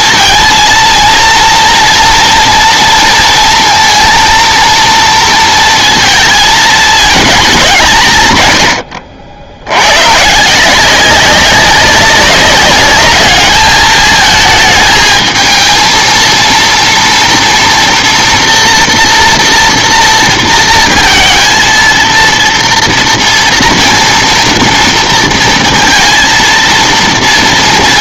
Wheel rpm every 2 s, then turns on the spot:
230, 230, 230, 220, 110, 160, 200, 220, 230, 240, 230, 230, 230, 230.
none